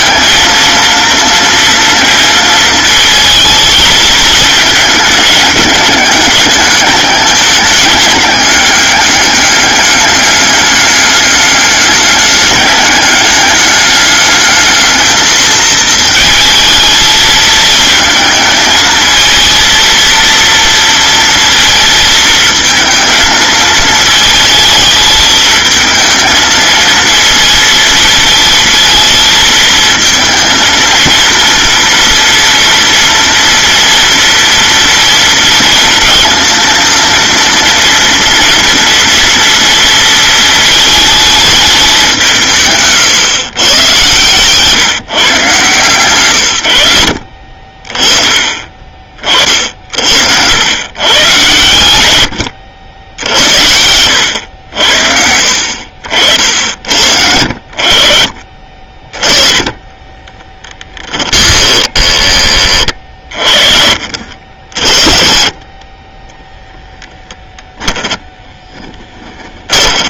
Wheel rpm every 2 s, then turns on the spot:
230, 220, 210, 210, 200, 210, 200, 220, 220, 230, 230, 220, 220, 230, 220, 230, 230, 230, 230, 230, 220, 130, 140, 80, 40, 120, 70, 70, 70, 20, 20, 50, 30, 10, 20.
60-62 66-70